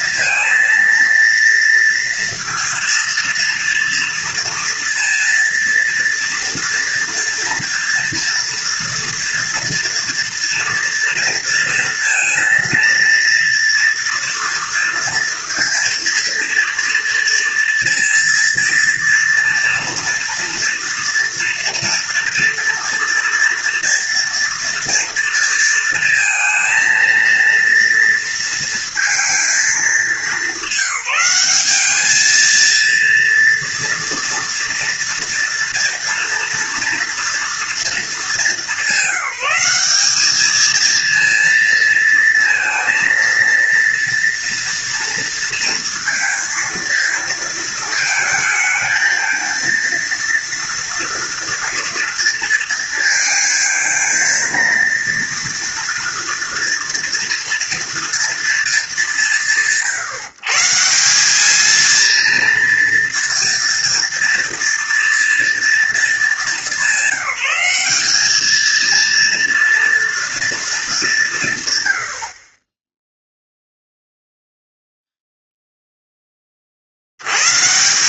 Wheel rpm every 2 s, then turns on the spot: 230, 230, 230, 230, 240, 230, 230, 230, 230, 230, 230, 240, 230, 230, 230, 190, 230, 230, 240, 200, 220, 230, 230, 230, 220, 230, 230, 230, 230, 210, 160, 230, 230, 200, 220, 210, 20, 0, 50.
none